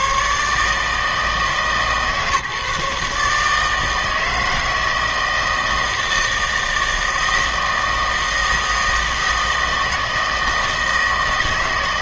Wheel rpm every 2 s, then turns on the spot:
150, 150, 160, 160, 160, 160.
none